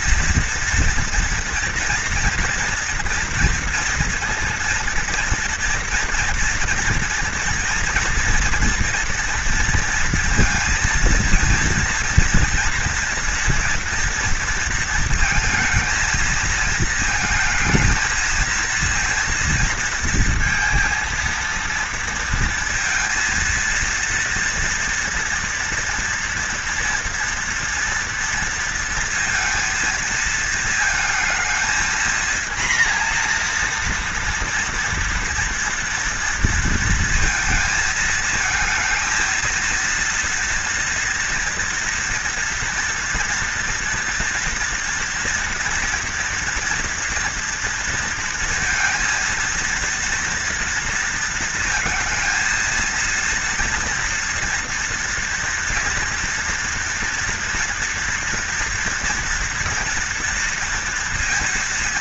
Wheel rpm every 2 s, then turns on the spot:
230, 230, 230, 230, 230, 230, 230, 230, 220, 230, 230, 230, 230, 240, 230, 230, 230, 230, 230, 230, 230, 230, 230, 240, 230, 230, 230, 230, 230, 230, 230.
none